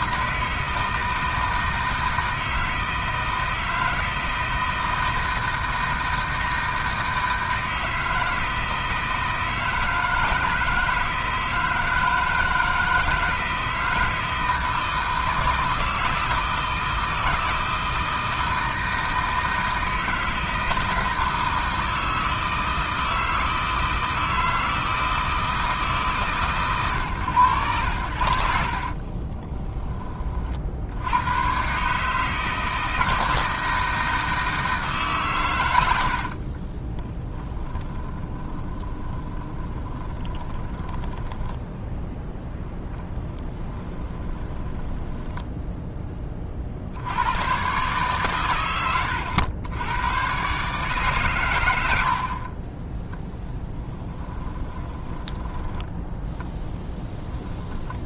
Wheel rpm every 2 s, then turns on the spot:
160, 160, 160, 160, 160, 160, 160, 160, 160, 160, 160, 160, 160, 120, 50, 70, 160, 150, 20, 20, 10, 10, 10, 60, 100, 140, 20, 20, 10.
28-30 36-42 44-46 54-56